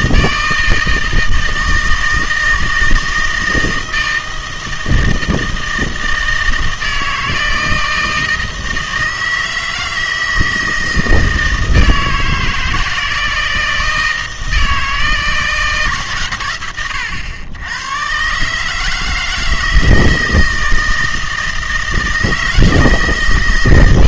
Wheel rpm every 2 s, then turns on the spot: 160, 160, 160, 160, 160, 160, 160, 160, 110, 150, 160, 160.
none